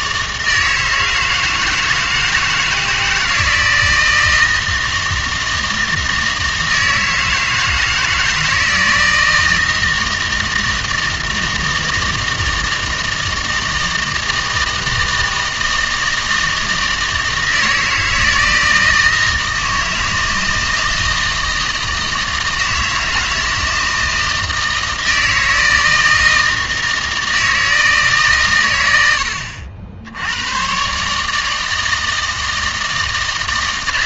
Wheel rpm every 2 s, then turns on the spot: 160, 160, 160, 160, 160, 160, 160, 160, 160, 160, 160, 160, 160, 160, 90, 130, 160.
none